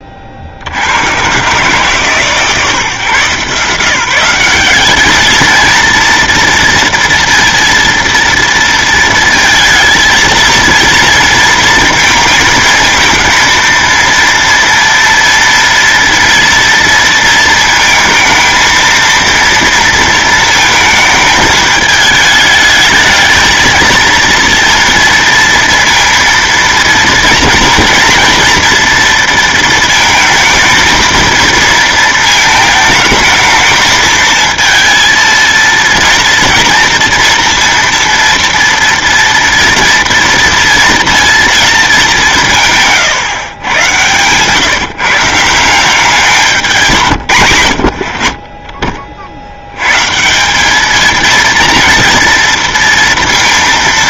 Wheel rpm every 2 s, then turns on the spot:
60, 140, 190, 230, 230, 230, 220, 230, 230, 230, 230, 210, 230, 230, 230, 220, 220, 220, 230, 230, 230, 150, 140, 180, 40, 180, 230.
48-50